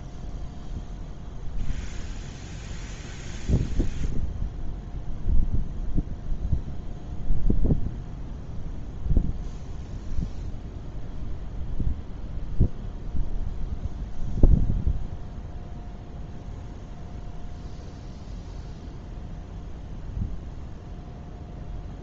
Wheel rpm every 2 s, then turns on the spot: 0, 0, 0, 0, 0, 0, 0, 0, 0, 0, 0.
none